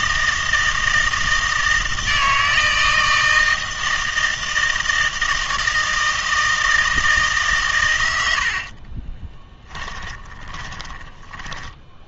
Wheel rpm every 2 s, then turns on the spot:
160, 160, 160, 160, 50, 20.
8-12